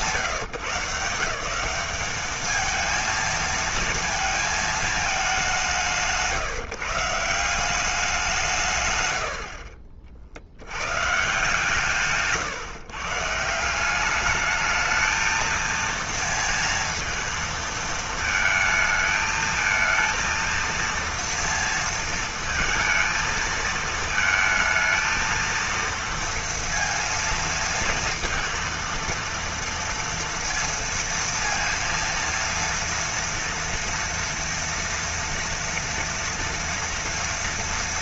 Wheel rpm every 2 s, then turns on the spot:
170, 220, 220, 150, 160, 70, 150, 210, 230, 220, 230, 230, 220, 230, 230, 230, 230, 240, 230.
none